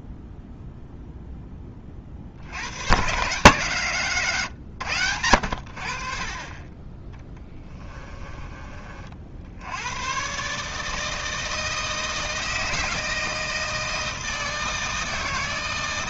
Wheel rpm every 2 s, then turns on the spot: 0, 110, 110, 20, 40, 150, 160, 160.
none